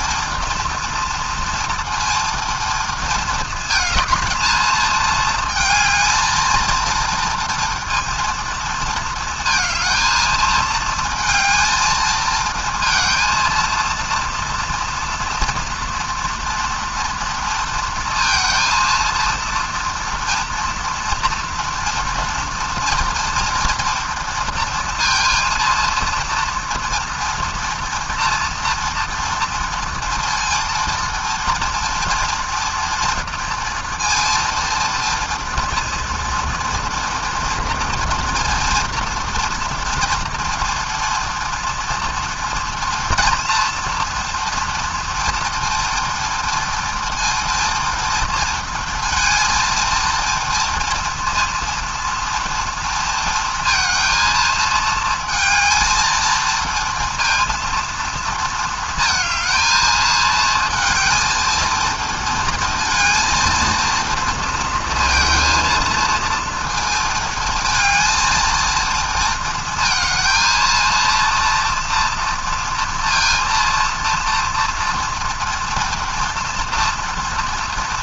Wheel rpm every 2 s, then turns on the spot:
230, 230, 220, 230, 230, 220, 230, 230, 230, 230, 230, 230, 230, 230, 230, 230, 240, 230, 230, 230, 240, 240, 230, 230, 230, 230, 230, 220, 230, 220, 220, 230, 230, 230, 230, 230, 230, 230, 230.
none